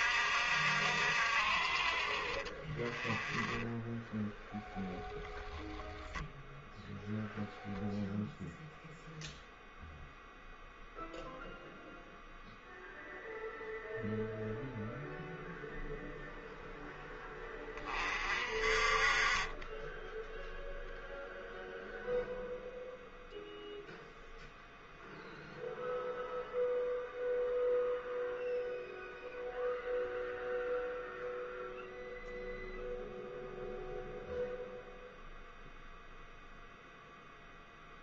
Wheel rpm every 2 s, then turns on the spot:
60, 30, 0, 0, 0, 0, 0, 0, 0, 40, 0, 0, 0, 0, 0, 0, 0, 0, 0.
none